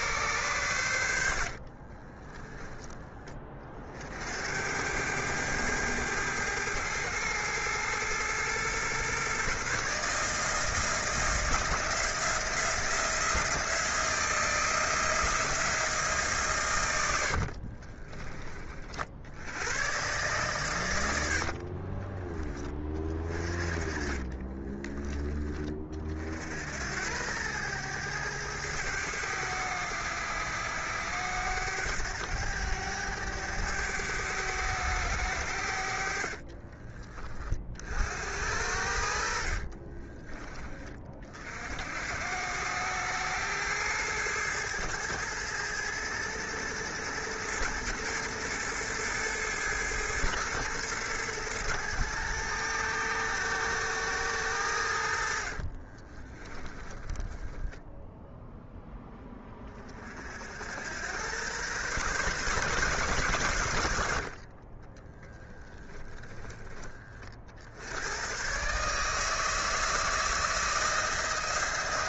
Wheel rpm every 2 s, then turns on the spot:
110, 30, 90, 110, 120, 160, 170, 160, 120, 50, 110, 20, 20, 80, 100, 100, 100, 100, 30, 70, 30, 100, 110, 110, 110, 110, 110, 90, 10, 10, 90, 130, 30, 10, 140, 160.
2-4 16-18 24-26 36-40 56-58 64-66